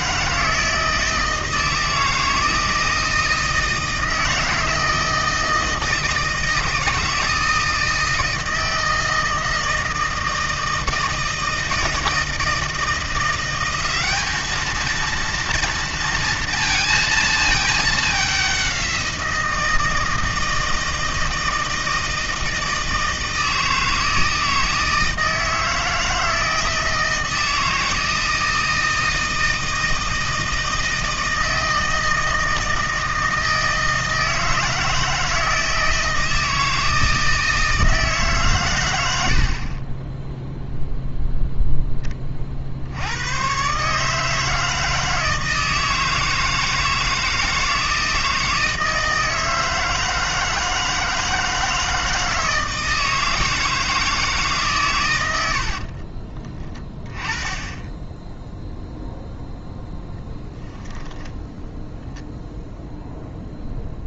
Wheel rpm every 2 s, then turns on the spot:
160, 160, 160, 160, 160, 160, 170, 220, 230, 190, 160, 160, 160, 160, 160, 160, 160, 160, 160, 110, 0, 70, 160, 160, 160, 160, 160, 120, 20, 0, 10, 0.
60-62